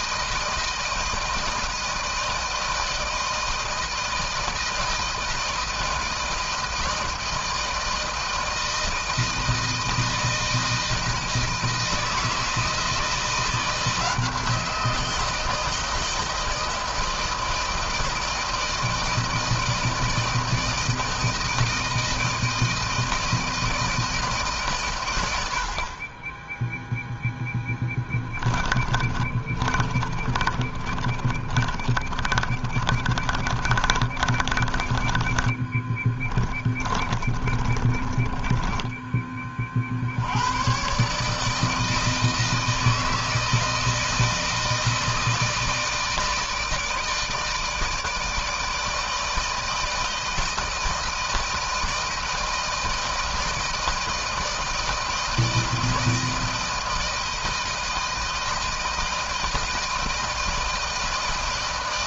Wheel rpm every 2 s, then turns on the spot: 160, 160, 160, 160, 160, 160, 160, 170, 160, 160, 160, 160, 110, 0, 20, 30, 30, 20, 30, 20, 130, 160, 160, 160, 160, 160, 160, 160, 160, 160, 160.
28-34 36-38